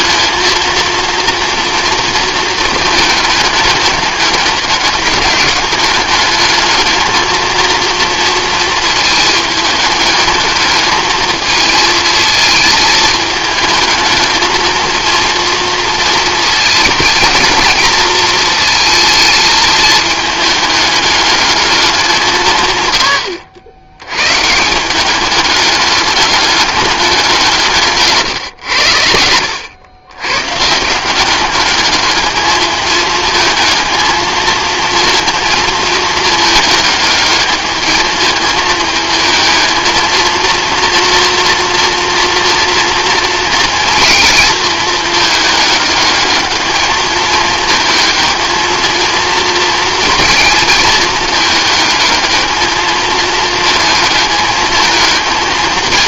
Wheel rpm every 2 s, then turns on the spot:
230, 220, 210, 220, 230, 210, 220, 230, 230, 220, 210, 130, 170, 210, 100, 150, 220, 220, 220, 220, 230, 230, 220, 210, 220, 230, 220, 220.
none